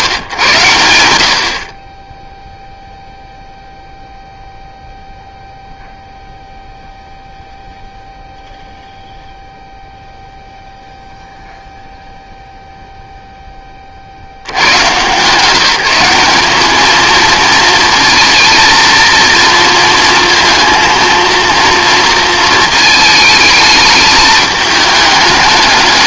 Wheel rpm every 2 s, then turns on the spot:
100, 0, 0, 0, 0, 0, 0, 120, 200, 230, 230, 220, 210.
none